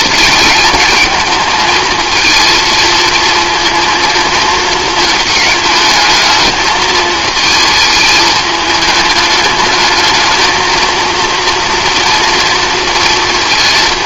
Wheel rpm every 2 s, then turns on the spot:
220, 230, 220, 220, 210, 230, 230.
none